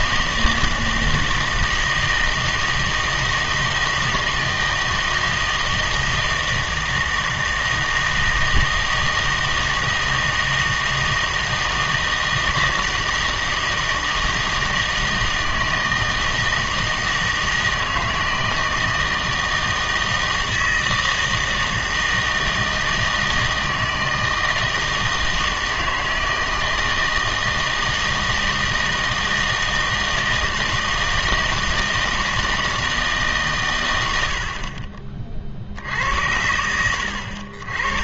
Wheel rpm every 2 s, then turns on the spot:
160, 160, 160, 160, 160, 160, 160, 160, 160, 160, 160, 160, 160, 160, 160, 160, 160, 40, 80.
none